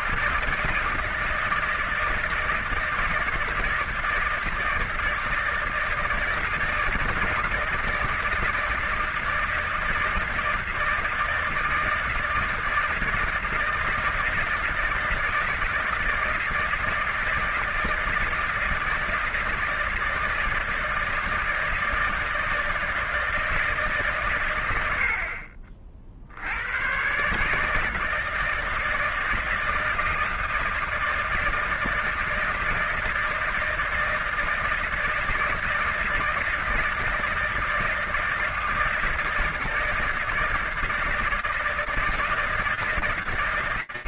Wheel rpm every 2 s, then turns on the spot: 160, 160, 160, 160, 160, 160, 160, 160, 160, 160, 160, 160, 110, 80, 160, 160, 160, 160, 160, 160, 160, 160.
none